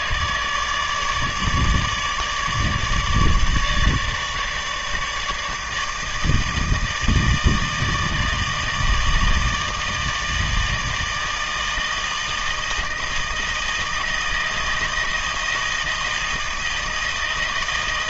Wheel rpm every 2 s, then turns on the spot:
150, 150, 160, 160, 160, 160, 160, 160, 160.
none